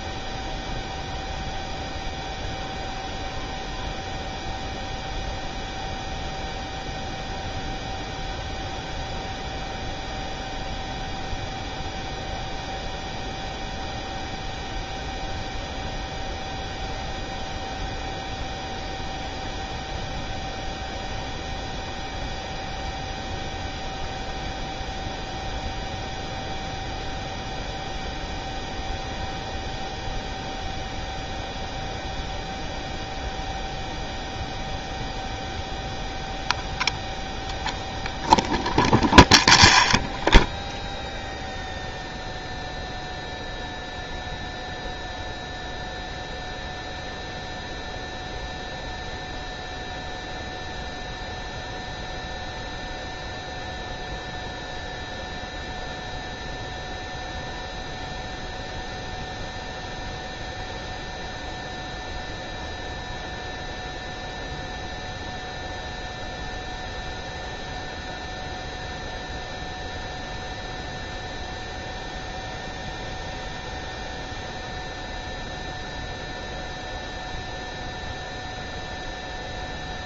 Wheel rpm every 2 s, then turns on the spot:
0, 0, 0, 0, 0, 0, 0, 0, 0, 0, 0, 0, 0, 0, 0, 0, 0, 0, 0, 0, 0, 0, 0, 0, 0, 0, 0, 0, 0, 0, 0, 0, 0, 0, 0, 0, 0, 0, 0, 0.
none